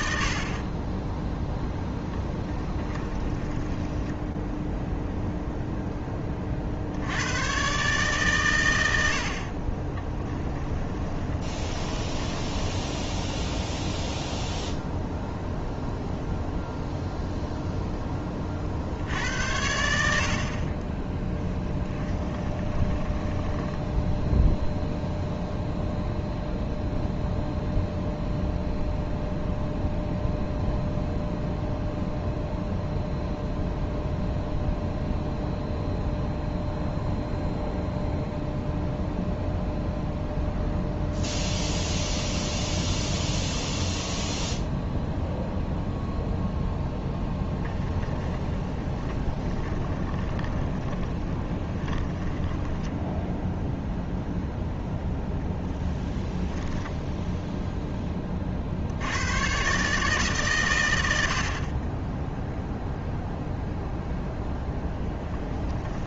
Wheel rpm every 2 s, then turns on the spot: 20, 20, 0, 80, 80, 20, 10, 0, 0, 80, 20, 20, 0, 0, 0, 0, 0, 0, 0, 0, 0, 0, 0, 0, 20, 20, 0, 0, 0, 90, 100, 0, 0.
2-4 10-12 20-24 48-52